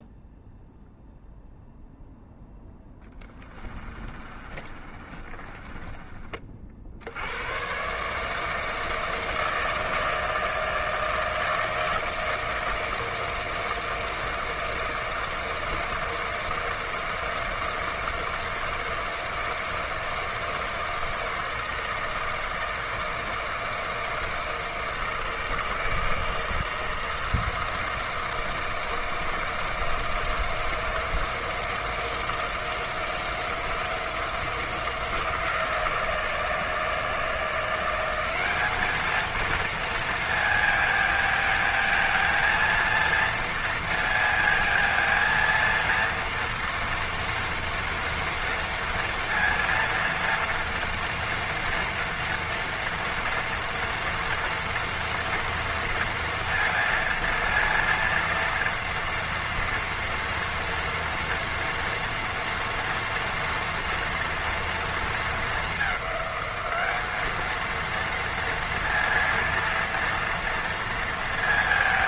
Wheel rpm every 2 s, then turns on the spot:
0, 0, 30, 50, 160, 160, 160, 160, 160, 160, 160, 160, 160, 160, 160, 170, 170, 170, 160, 200, 230, 230, 230, 230, 230, 230, 230, 230, 230, 230, 230, 230, 230, 200, 230, 230.
4-6